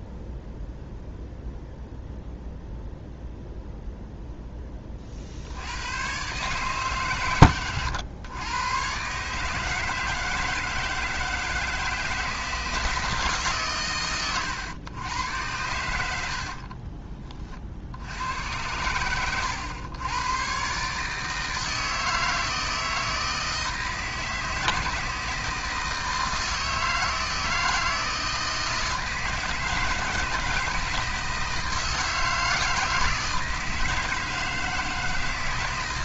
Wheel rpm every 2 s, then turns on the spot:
0, 0, 10, 140, 120, 160, 160, 100, 40, 100, 130, 160, 160, 160, 160, 160, 160, 160.
16-18